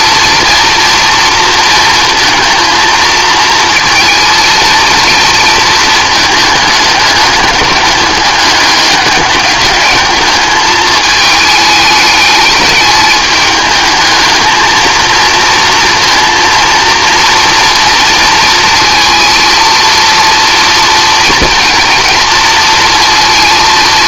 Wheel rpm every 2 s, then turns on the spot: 230, 230, 230, 210, 200, 220, 210, 220, 230, 230, 230, 230.
none